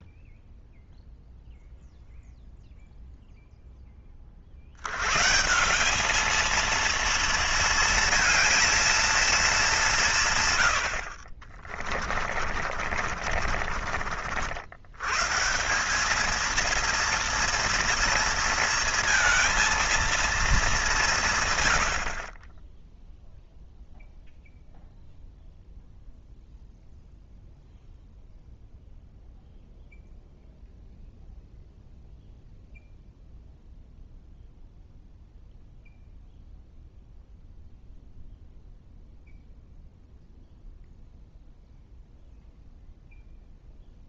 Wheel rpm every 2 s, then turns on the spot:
0, 0, 80, 230, 230, 90, 40, 90, 230, 230, 210, 20, 0, 0, 0, 0, 0, 0, 0, 0, 0, 0.
12-14